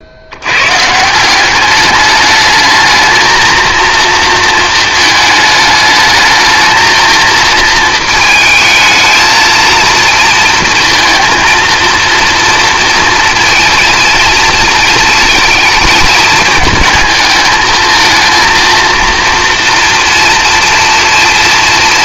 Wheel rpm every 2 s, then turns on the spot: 140, 220, 220, 220, 220, 230, 230, 230, 220, 230, 230.
none